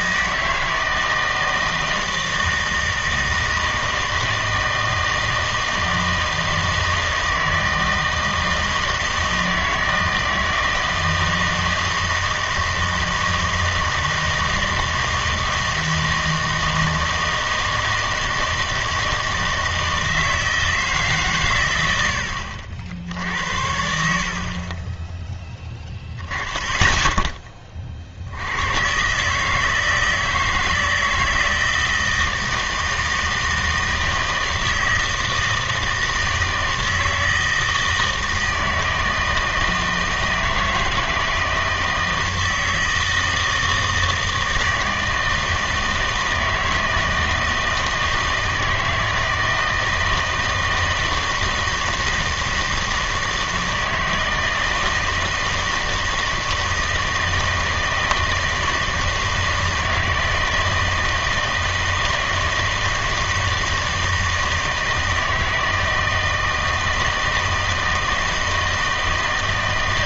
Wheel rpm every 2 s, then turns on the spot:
160, 160, 160, 160, 160, 160, 160, 160, 160, 160, 160, 70, 30, 10, 110, 160, 160, 160, 160, 160, 160, 160, 160, 160, 160, 160, 160, 160, 160, 160, 160, 160, 160, 160, 160.
none